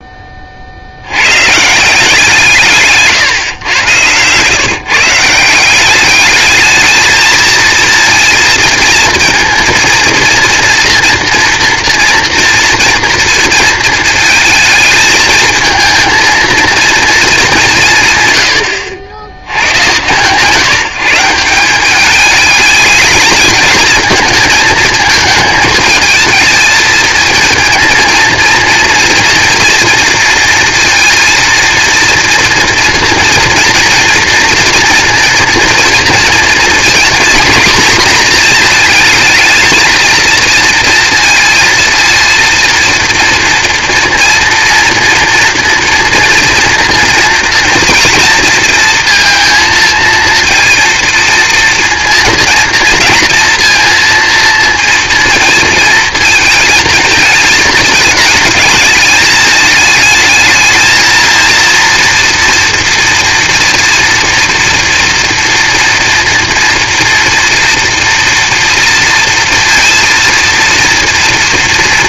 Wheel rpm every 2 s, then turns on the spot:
90, 150, 150, 220, 230, 230, 230, 220, 220, 70, 160, 220, 220, 230, 230, 230, 230, 230, 230, 220, 230, 230, 230, 230, 230, 230, 230, 230, 220, 210, 220, 230, 240, 230, 230, 230.
2-4